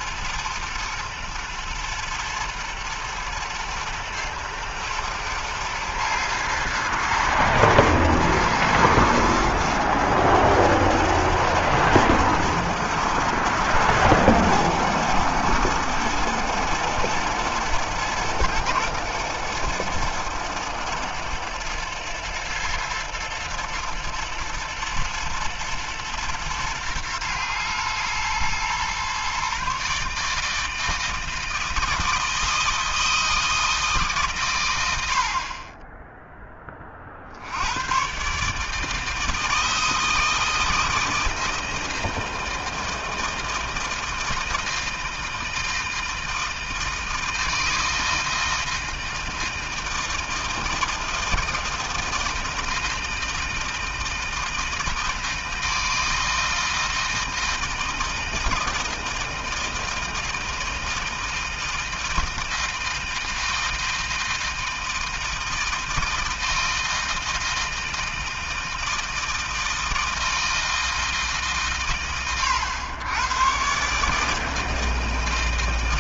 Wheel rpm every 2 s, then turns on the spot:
120, 120, 120, 110, 110, 120, 110, 110, 110, 110, 120, 110, 110, 120, 130, 160, 160, 80, 50, 160, 160, 160, 160, 160, 160, 160, 160, 160, 160, 160, 160, 160, 160, 160, 160, 160, 110, 160.
none